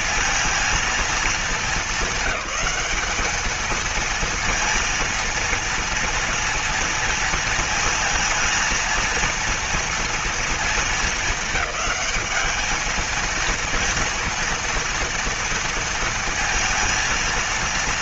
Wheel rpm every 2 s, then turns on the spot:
230, 210, 230, 230, 230, 230, 210, 230, 230.
none